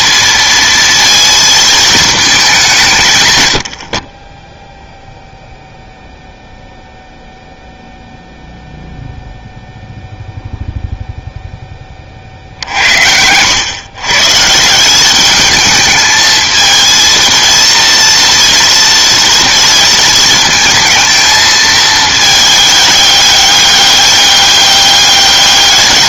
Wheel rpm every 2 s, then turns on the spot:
230, 190, 0, 0, 0, 0, 70, 170, 220, 230, 230, 210, 200.
none